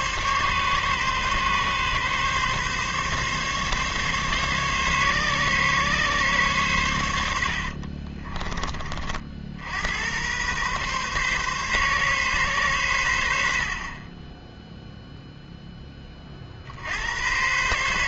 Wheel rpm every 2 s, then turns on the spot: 140, 140, 140, 110, 30, 130, 110, 0, 70.
none